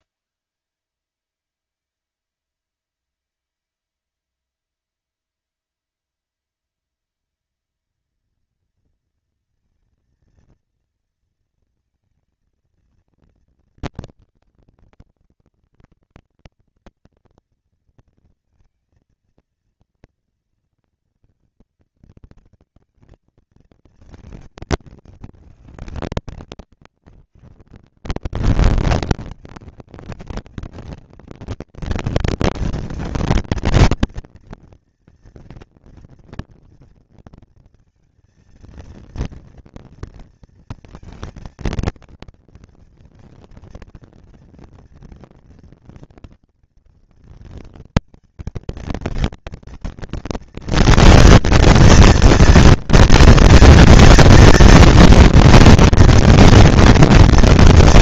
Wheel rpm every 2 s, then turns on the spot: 190, 220, 230, 230, 230, 230, 230, 220, 230, 230, 230, 220, 220, 150, 130, 200, 220, 230, 230, 230, 230, 230, 230, 230, 220, 230, 230, 230, 240.
none